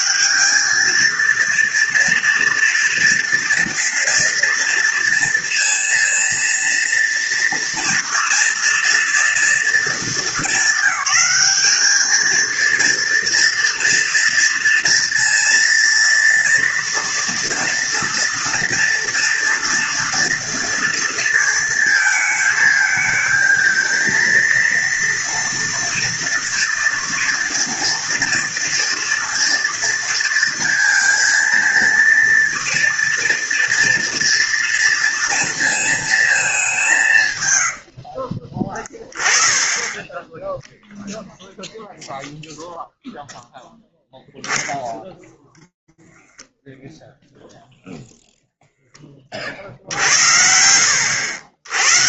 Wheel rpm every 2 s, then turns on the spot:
220, 230, 230, 230, 230, 200, 230, 230, 230, 230, 230, 220, 230, 230, 230, 230, 230, 230, 180, 20, 0, 0, 0, 0, 40, 80.
none